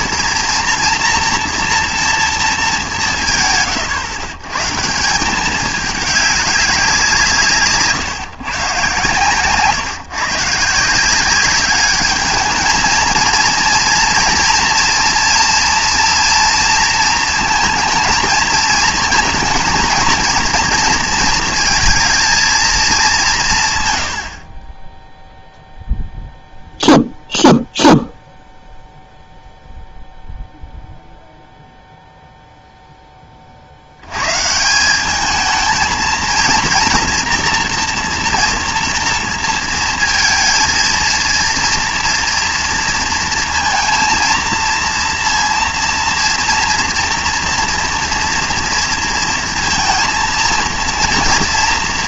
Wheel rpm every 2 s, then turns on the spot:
240, 210, 140, 200, 140, 160, 220, 230, 230, 220, 230, 220, 20, 0, 0, 0, 0, 170, 240, 230, 230, 230, 230, 230, 230, 230.
none